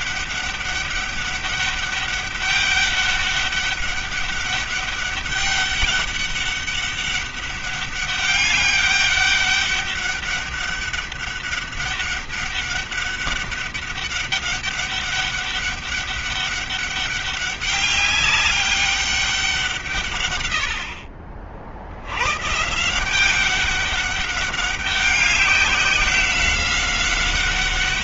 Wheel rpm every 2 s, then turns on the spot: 200, 200, 200, 200, 200, 200, 200, 200, 200, 200, 60, 160, 200, 190.
none